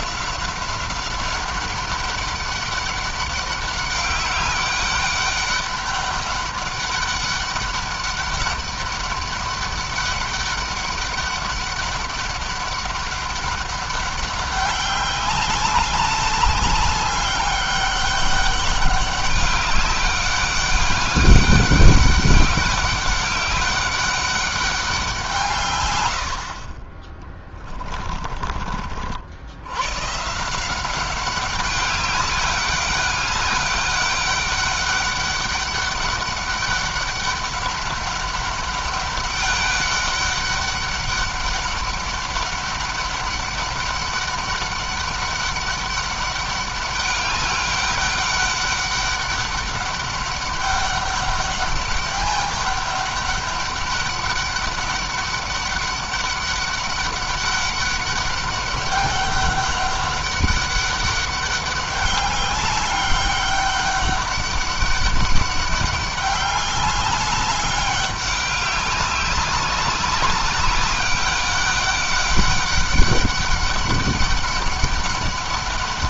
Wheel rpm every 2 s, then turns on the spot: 190, 200, 200, 200, 200, 200, 200, 200, 200, 200, 200, 200, 200, 40, 40, 170, 200, 200, 200, 200, 200, 200, 200, 200, 200, 200, 200, 200, 200, 200, 200, 200, 200, 200, 200, 200, 200, 200.
none